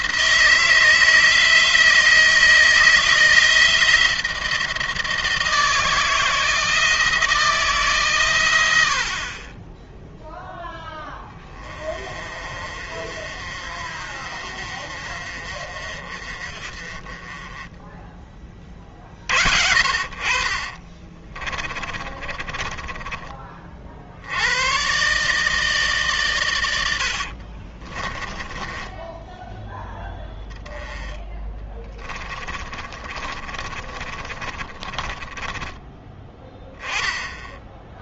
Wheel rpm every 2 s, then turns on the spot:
160, 160, 160, 160, 70, 10, 40, 40, 30, 50, 30, 20, 120, 90, 10, 10, 30, 20, 10.
20-24 26-30 32-36